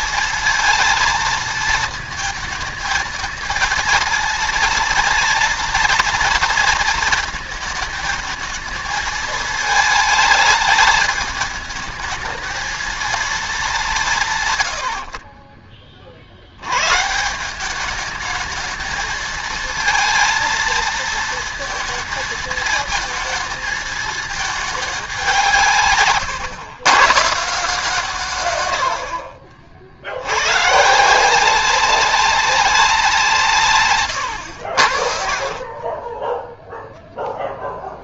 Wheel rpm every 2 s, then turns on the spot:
230, 230, 230, 230, 220, 210, 220, 110, 100, 220, 230, 220, 210, 120, 90, 150, 180, 60, 0.
34-36